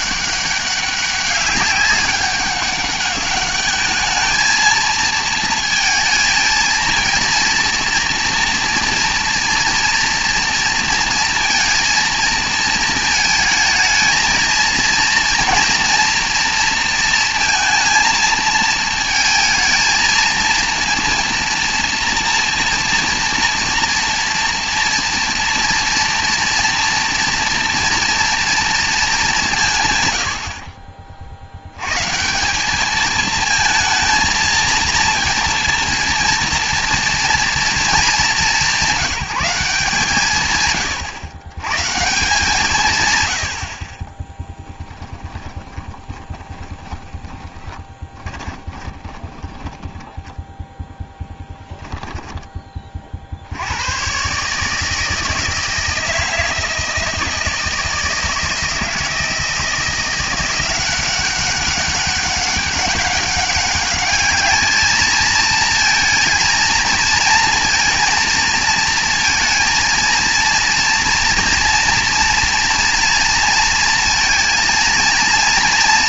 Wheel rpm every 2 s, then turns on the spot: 200, 200, 230, 230, 230, 230, 230, 230, 230, 220, 230, 230, 230, 230, 230, 50, 190, 230, 230, 200, 130, 150, 10, 20, 20, 10, 20, 150, 160, 160, 180, 200, 220, 230, 230, 230, 230, 230.
30-32 44-52